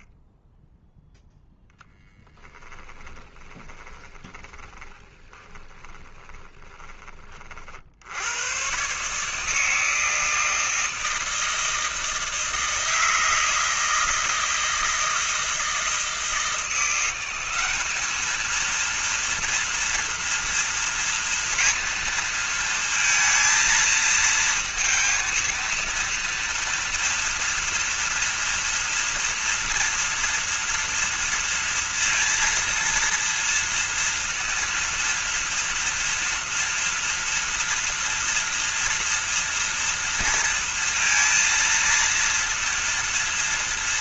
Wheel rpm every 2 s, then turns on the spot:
0, 20, 20, 20, 140, 160, 160, 160, 170, 230, 230, 230, 230, 230, 230, 230, 230, 230, 230, 240, 230, 230.
2-8